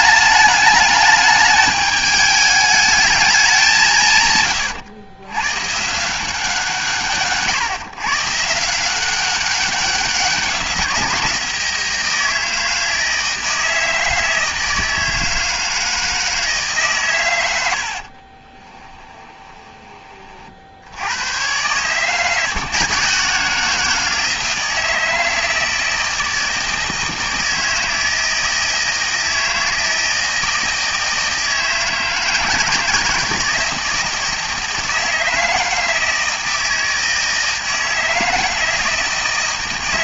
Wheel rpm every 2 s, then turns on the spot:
210, 210, 110, 150, 170, 180, 160, 160, 140, 20, 90, 160, 160, 160, 160, 160, 160, 160, 160, 160.
18-20